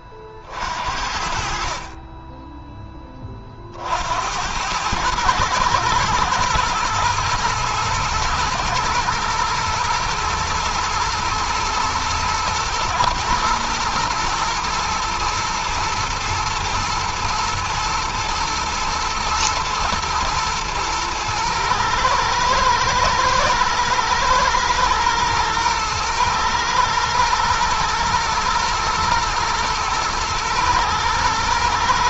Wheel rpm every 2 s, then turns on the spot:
60, 10, 110, 120, 120, 120, 120, 120, 110, 110, 110, 110, 120, 120, 120, 110.
none